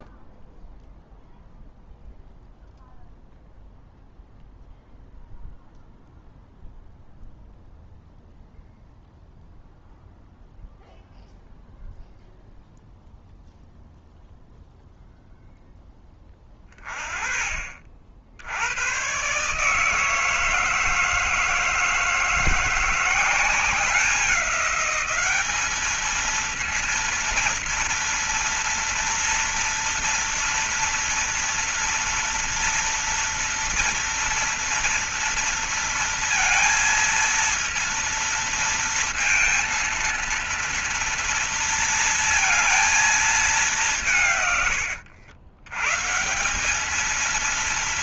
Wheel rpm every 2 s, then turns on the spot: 0, 0, 0, 0, 0, 0, 0, 0, 20, 80, 160, 160, 190, 220, 230, 230, 230, 230, 230, 230, 230, 230, 150, 150.
none